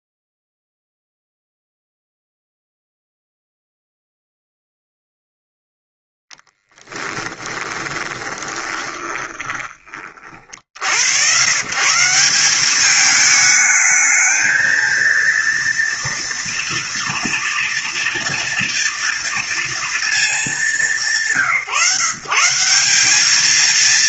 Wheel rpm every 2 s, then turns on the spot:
0, 0, 0, 10, 20, 60, 200, 230, 230, 230, 200, 170.
6-10